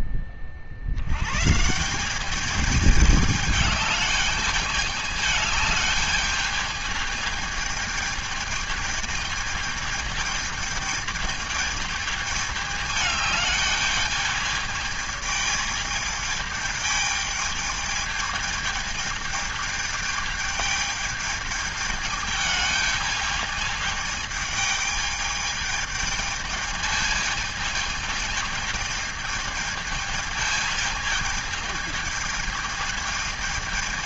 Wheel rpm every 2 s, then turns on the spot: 50, 210, 210, 210, 220, 220, 210, 210, 220, 210, 210, 210, 210, 220, 210, 220, 210.
none